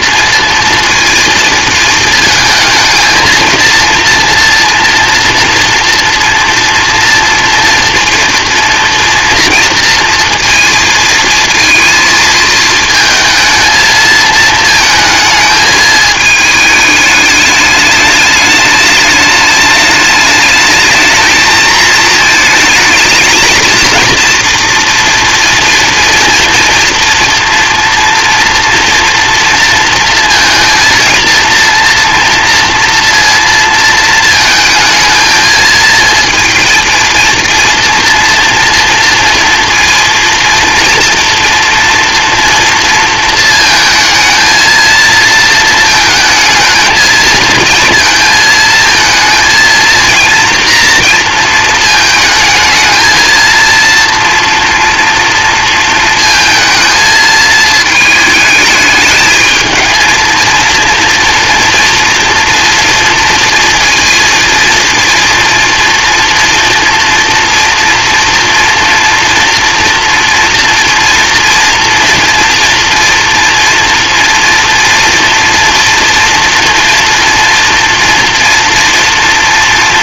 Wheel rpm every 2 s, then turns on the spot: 230, 220, 240, 240, 230, 230, 220, 220, 210, 210, 220, 220, 230, 230, 230, 230, 230, 220, 230, 230, 230, 230, 230, 220, 230, 230, 220, 230, 220, 220, 230, 230, 230, 230, 230, 230, 240, 230, 230, 230.
none